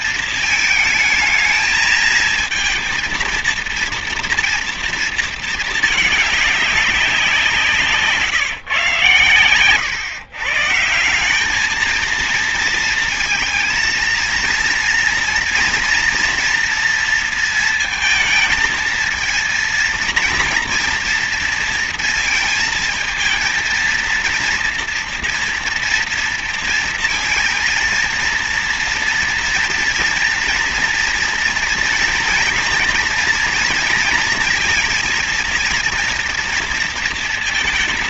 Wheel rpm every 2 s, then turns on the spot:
220, 220, 230, 200, 150, 160, 230, 230, 230, 220, 240, 220, 230, 230, 230, 230, 240, 230, 230.
none